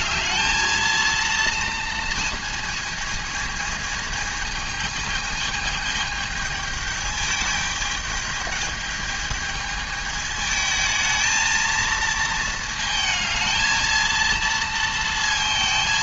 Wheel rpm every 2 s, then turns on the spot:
230, 220, 220, 210, 210, 220, 220, 230.
none